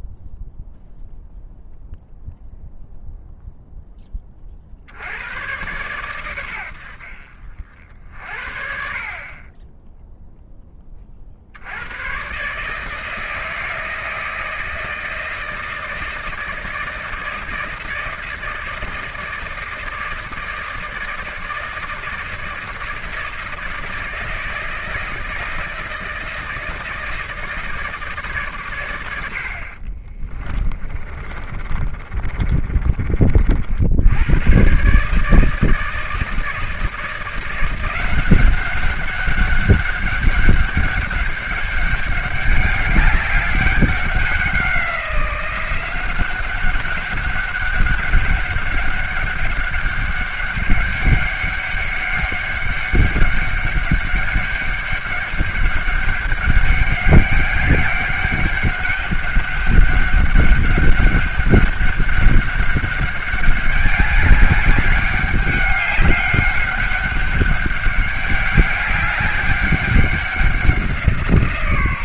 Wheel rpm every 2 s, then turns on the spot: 0, 0, 50, 90, 50, 10, 140, 160, 160, 160, 160, 160, 160, 160, 120, 30, 30, 120, 160, 190, 200, 200, 190, 190, 200, 200, 200, 200, 200, 200, 200, 200, 200, 200, 200, 180.
30-34